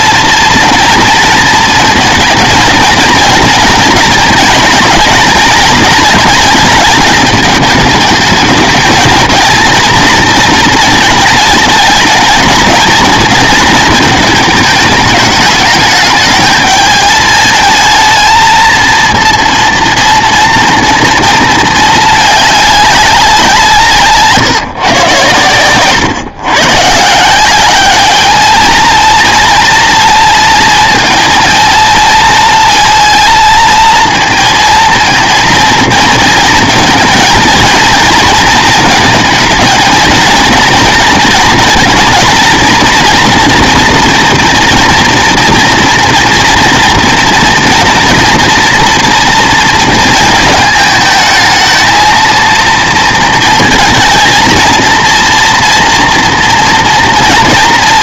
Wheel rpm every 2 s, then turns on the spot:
230, 220, 220, 220, 220, 220, 220, 220, 210, 230, 230, 210, 150, 130, 220, 230, 230, 220, 230, 220, 230, 230, 230, 230, 230, 220, 230, 230, 230.
none